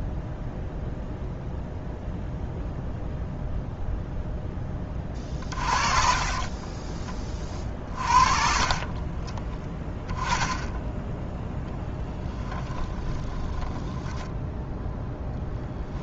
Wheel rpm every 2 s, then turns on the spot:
0, 0, 20, 30, 40, 10, 20, 0.
6-10 12-14